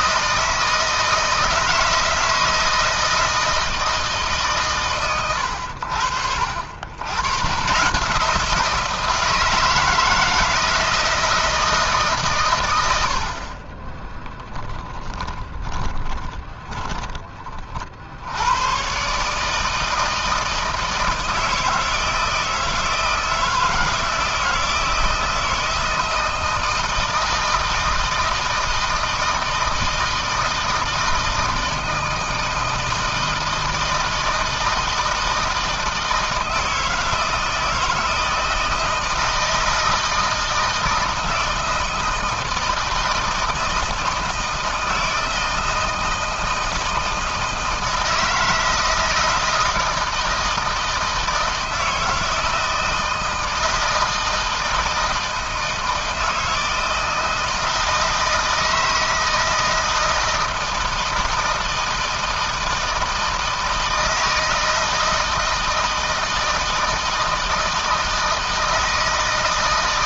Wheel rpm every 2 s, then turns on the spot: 160, 160, 120, 60, 160, 160, 90, 20, 40, 120, 160, 160, 160, 160, 160, 160, 160, 160, 160, 160, 160, 160, 160, 170, 160, 160, 160, 160, 160, 160, 160, 160, 160, 160, 160.
14-18